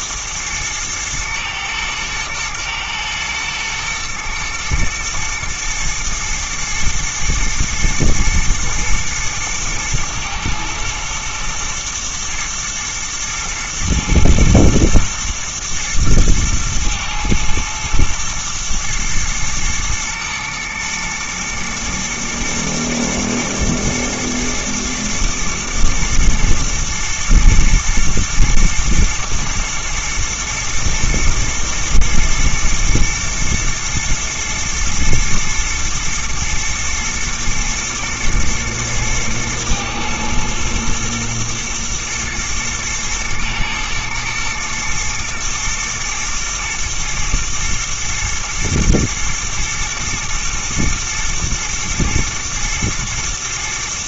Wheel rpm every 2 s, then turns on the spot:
110, 110, 110, 110, 120, 110, 110, 110, 110, 120, 110, 120, 120, 110, 110, 120, 120, 110, 120, 110, 110, 120, 110, 120, 120, 110, 110.
none